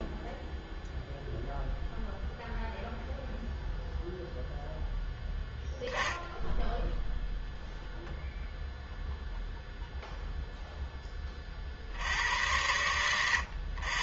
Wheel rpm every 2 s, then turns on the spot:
0, 0, 0, 10, 0, 0, 100.
none